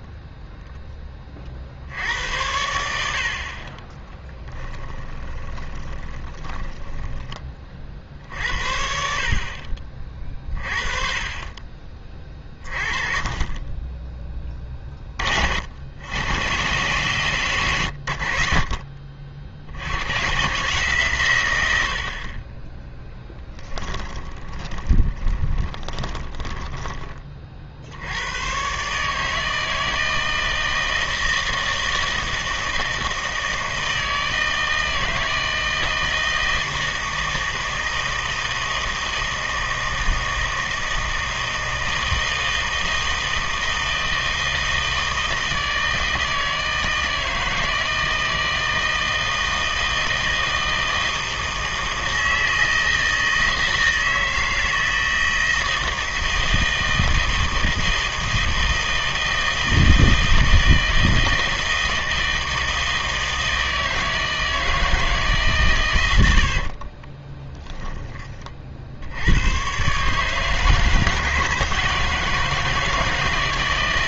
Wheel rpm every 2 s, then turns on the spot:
0, 80, 10, 10, 60, 30, 30, 20, 120, 60, 130, 20, 20, 20, 120, 160, 160, 160, 160, 160, 160, 160, 160, 160, 160, 160, 160, 160, 160, 160, 160, 160, 160, 50, 40, 150, 160.
4-8 24-28 66-68